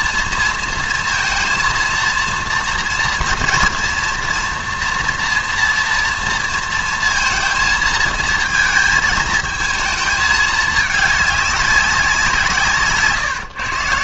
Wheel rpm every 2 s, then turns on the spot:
230, 230, 230, 230, 220, 220, 170.
none